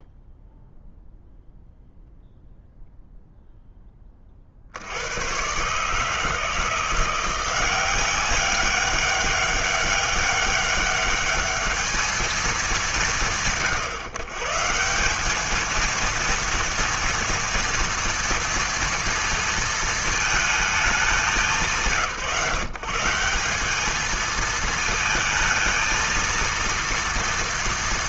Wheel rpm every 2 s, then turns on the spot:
0, 0, 60, 170, 200, 200, 150, 160, 230, 230, 220, 160, 220, 230.
none